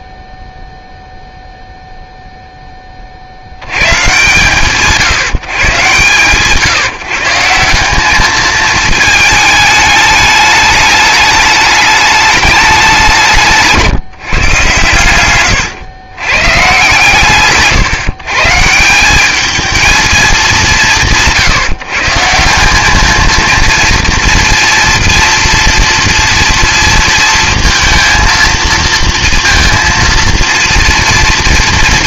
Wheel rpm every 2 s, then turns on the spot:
0, 10, 160, 140, 220, 210, 200, 130, 100, 160, 150, 190, 230, 230, 230, 230.
none